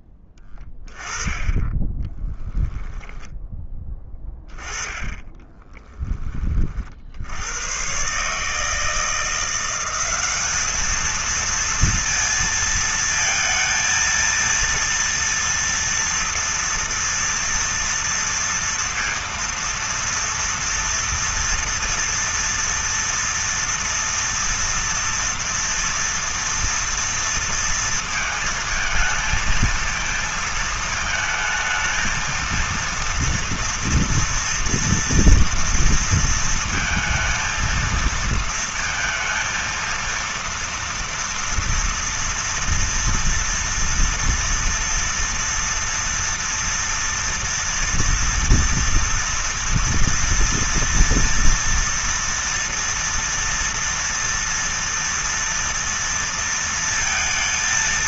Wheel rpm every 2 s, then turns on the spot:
10, 10, 10, 30, 150, 210, 230, 230, 230, 230, 230, 230, 230, 230, 220, 230, 230, 230, 230, 220, 230, 230, 230, 230, 240, 230, 230, 230, 230.
2-4